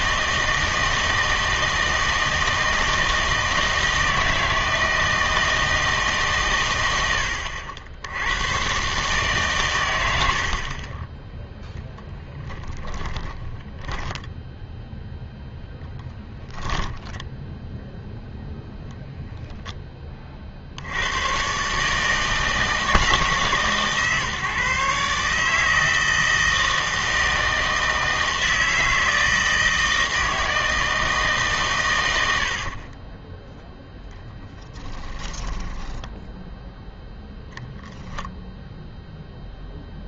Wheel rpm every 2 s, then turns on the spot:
160, 160, 160, 100, 130, 40, 10, 0, 0, 0, 60, 160, 150, 160, 160, 160, 60, 10, 0, 0.
10-14 32-36